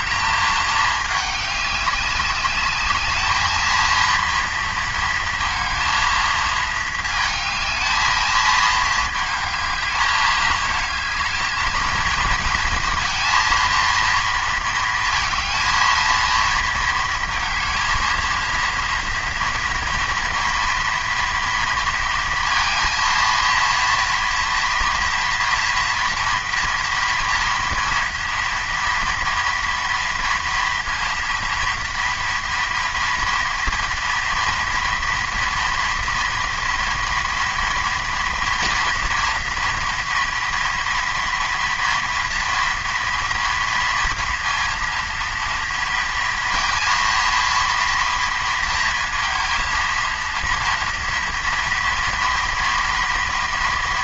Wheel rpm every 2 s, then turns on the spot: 210, 200, 230, 220, 220, 220, 230, 230, 230, 230, 230, 230, 230, 230, 230, 230, 230, 230, 240, 240, 230, 230, 230, 230, 230, 230, 230.
none